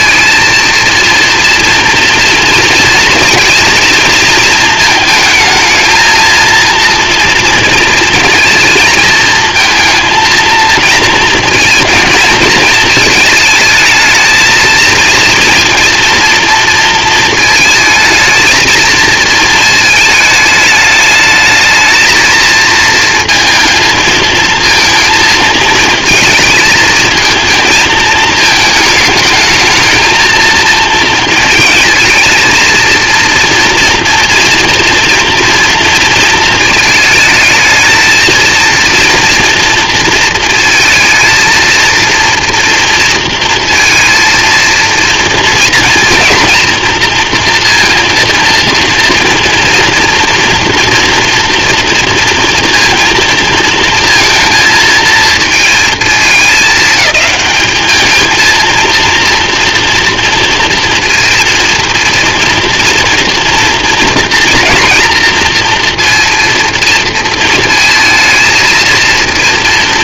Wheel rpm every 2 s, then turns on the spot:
230, 230, 230, 230, 230, 220, 220, 220, 230, 220, 220, 230, 230, 220, 220, 230, 220, 230, 230, 230, 230, 230, 230, 230, 230, 230, 230, 230, 220, 220, 230, 230, 230, 230, 230.
none